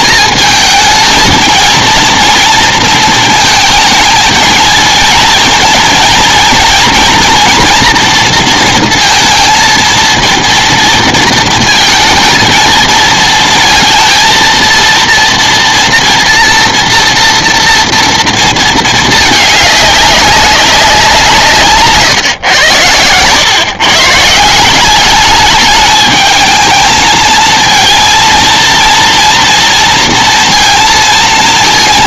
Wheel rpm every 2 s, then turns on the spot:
220, 230, 220, 230, 230, 230, 220, 230, 240, 230, 200, 130, 150, 210, 230, 230.
none